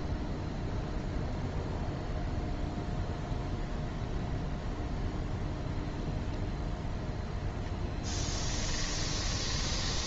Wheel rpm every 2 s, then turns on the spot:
0, 0, 0, 0, 10.
8-10